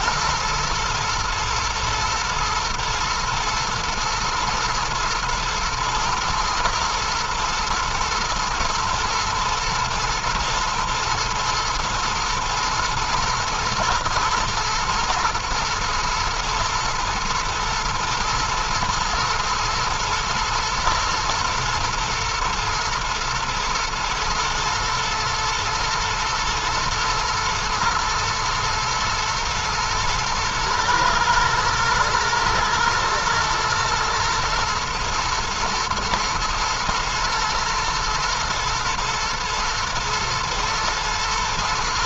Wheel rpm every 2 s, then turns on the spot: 110, 110, 110, 120, 110, 110, 120, 120, 110, 120, 110, 110, 110, 110, 110, 120, 120, 110, 120, 110, 110.
none